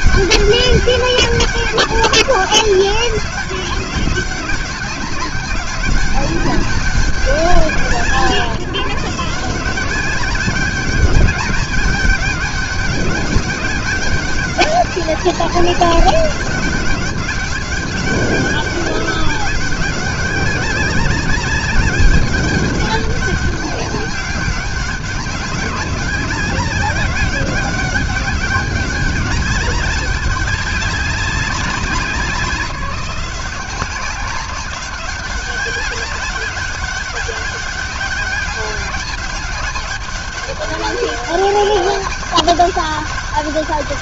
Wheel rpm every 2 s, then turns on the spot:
200, 200, 200, 190, 170, 210, 200, 200, 200, 200, 200, 200, 200, 200, 200, 200, 180, 190, 200, 200, 200, 200.
none